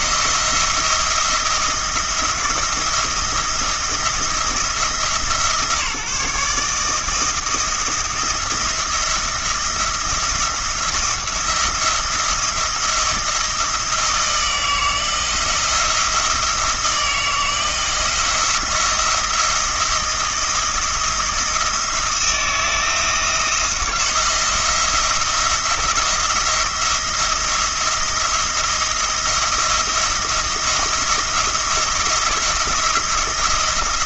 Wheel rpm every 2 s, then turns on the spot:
170, 170, 160, 160, 170, 170, 170, 160, 160, 160, 170, 170, 170, 170, 170, 170, 170.
none